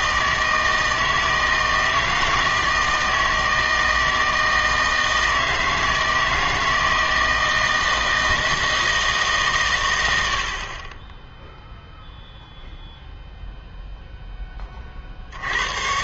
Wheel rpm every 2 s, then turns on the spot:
160, 160, 160, 160, 160, 30, 0, 30.
none